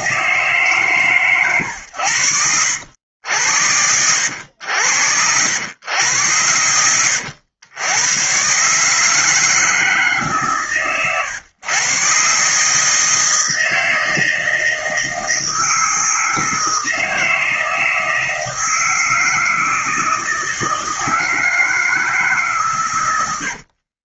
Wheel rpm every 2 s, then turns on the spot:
130, 80, 90, 90, 160, 120, 160, 160, 160, 160, 160, 100.
none